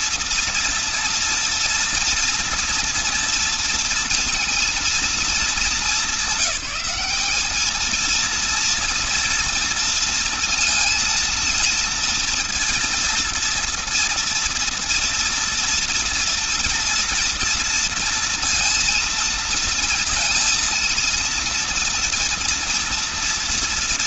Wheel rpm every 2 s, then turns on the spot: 230, 230, 230, 200, 230, 230, 230, 230, 230, 230, 230, 230.
none